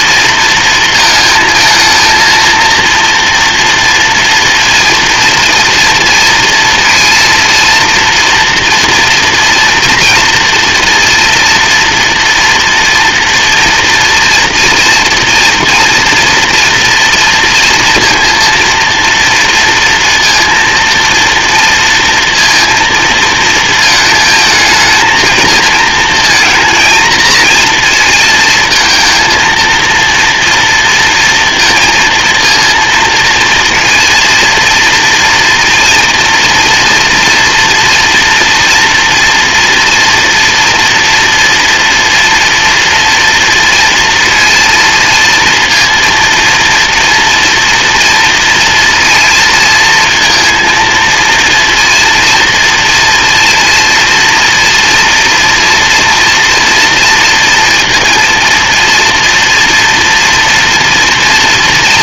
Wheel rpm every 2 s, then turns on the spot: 230, 230, 230, 230, 230, 230, 230, 230, 230, 230, 230, 220, 220, 230, 230, 230, 230, 230, 230, 230, 230, 230, 230, 240, 230, 230, 240, 230, 230, 230, 230.
none